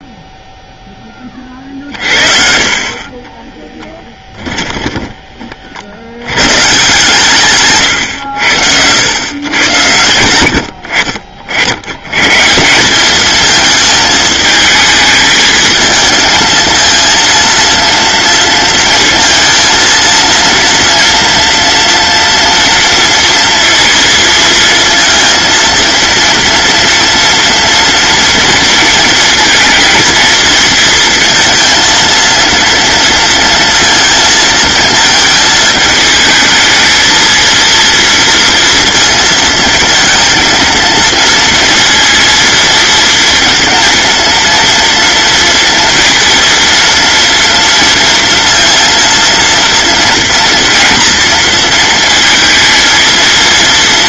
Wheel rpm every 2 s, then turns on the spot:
20, 30, 20, 140, 80, 70, 200, 220, 230, 230, 230, 230, 230, 230, 230, 230, 230, 220, 220, 230, 230, 230, 230, 230, 230, 230, 230.
2-6